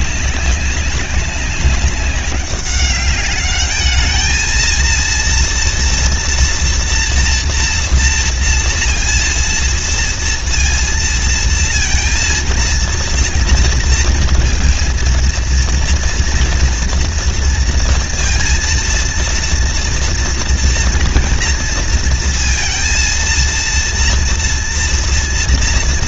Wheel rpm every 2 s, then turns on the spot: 190, 200, 220, 230, 230, 230, 230, 230, 230, 230, 230, 230, 230.
none